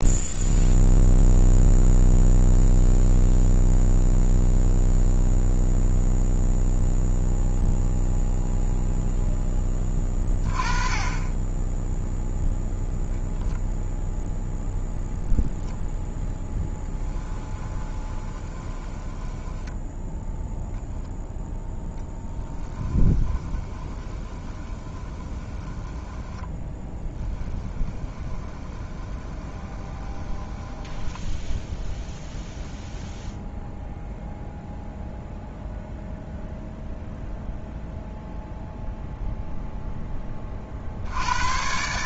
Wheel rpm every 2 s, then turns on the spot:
0, 0, 0, 0, 0, 20, 0, 0, 10, 20, 0, 10, 20, 10, 20, 10, 0, 0, 0, 0, 40.
16-20 22-32